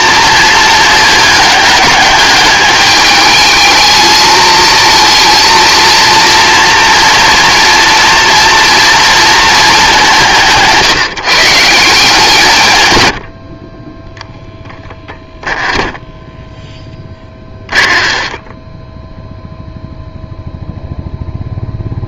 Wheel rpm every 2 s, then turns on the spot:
220, 210, 220, 230, 230, 160, 120, 10, 10, 10, 0.
16-20